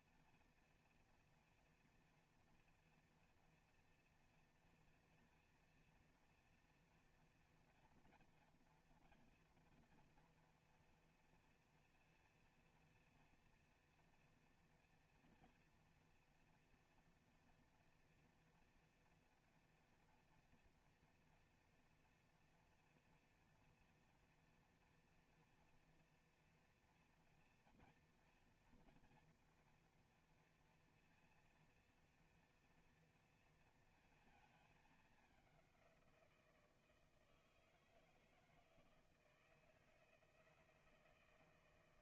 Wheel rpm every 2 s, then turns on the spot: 230, 230, 230, 230, 230, 240, 230, 230, 230, 230, 240, 240, 240, 230, 230, 230, 240, 220, 170, 160, 160.
none